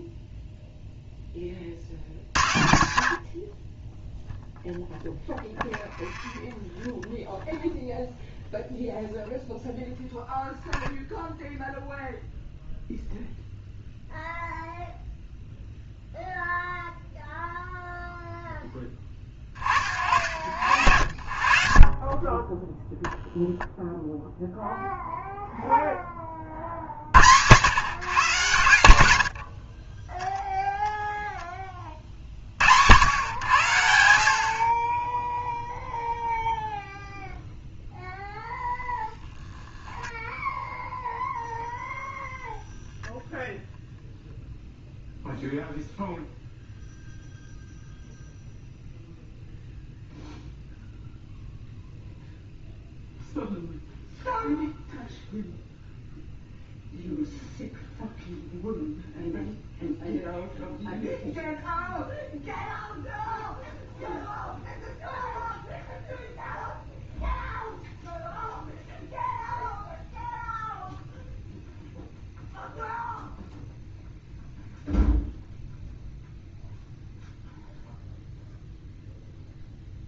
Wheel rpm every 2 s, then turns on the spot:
0, 60, 0, 0, 0, 0, 0, 0, 0, 10, 70, 10, 0, 60, 110, 0, 90, 40, 0, 0, 0, 0, 0, 0, 0, 0, 0, 0, 0, 0, 0, 0, 0, 0, 0, 0, 0, 0, 0, 0.
none